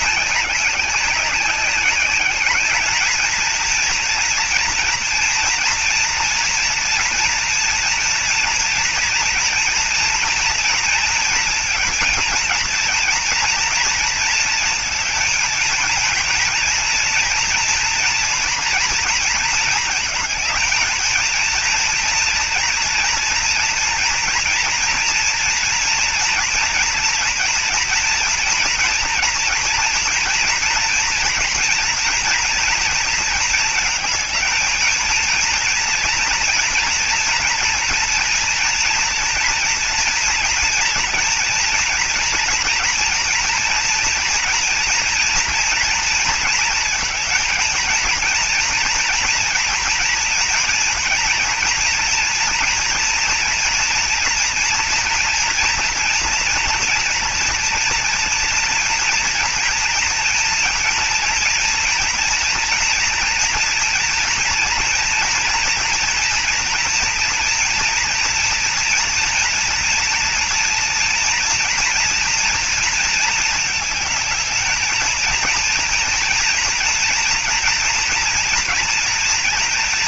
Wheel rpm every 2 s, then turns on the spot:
210, 190, 230, 230, 230, 240, 230, 230, 230, 230, 220, 230, 230, 230, 230, 230, 230, 220, 230, 230, 230, 230, 230, 230, 230, 230, 230, 230, 230, 230, 230, 230, 230, 230, 230, 240, 240, 220, 230, 230.
none